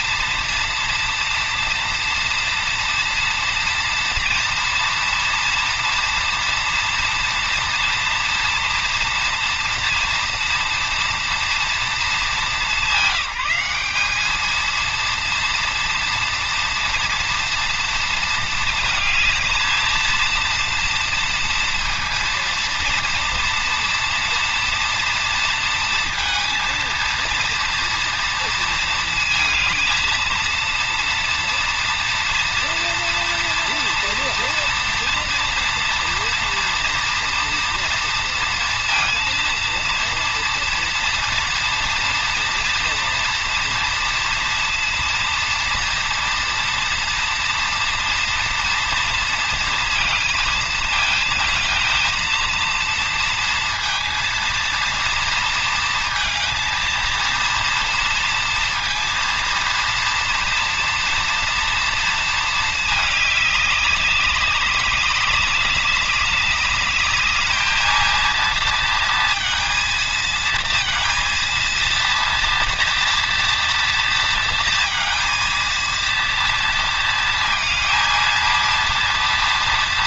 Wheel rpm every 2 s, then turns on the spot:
230, 230, 230, 230, 230, 240, 210, 230, 230, 220, 230, 230, 230, 230, 230, 230, 240, 240, 240, 230, 230, 230, 230, 230, 240, 220, 230, 230, 230, 230, 240, 220, 200, 200, 230, 230, 230, 230, 230, 230.
none